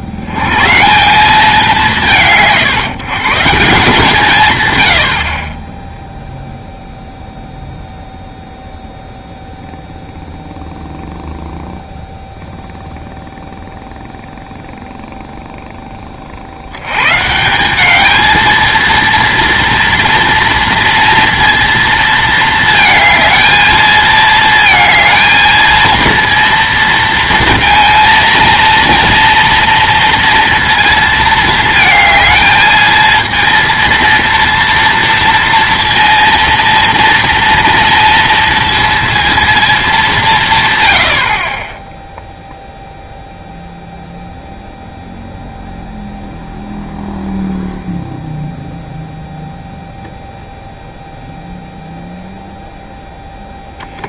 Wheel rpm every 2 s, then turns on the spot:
140, 140, 120, 0, 0, 0, 0, 0, 80, 220, 230, 220, 220, 230, 230, 230, 220, 230, 230, 230, 140, 0, 0, 0, 0, 0, 0.
none